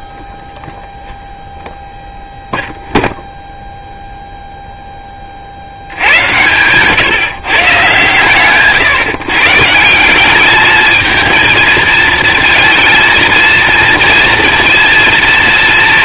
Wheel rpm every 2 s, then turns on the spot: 0, 0, 30, 150, 130, 220, 230, 230.
none